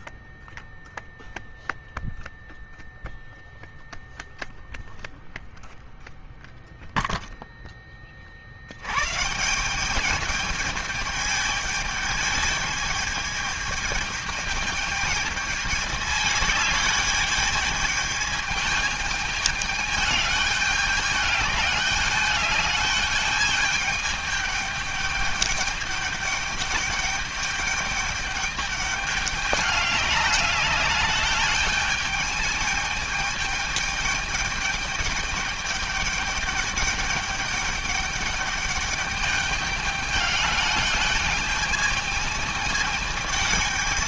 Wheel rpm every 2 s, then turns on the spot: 0, 0, 0, 0, 70, 210, 210, 210, 210, 210, 210, 210, 210, 210, 210, 210, 210, 210, 210, 210, 210, 220.
none